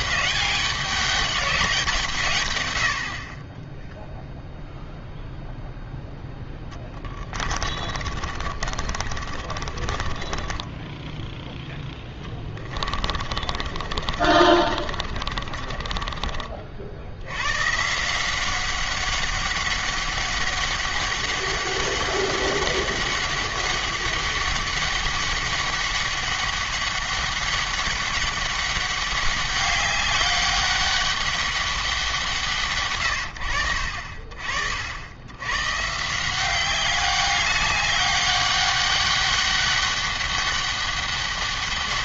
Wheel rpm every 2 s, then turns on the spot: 200, 100, 0, 10, 40, 10, 20, 40, 50, 190, 200, 200, 200, 200, 200, 200, 140, 70, 190, 200, 200.
6-16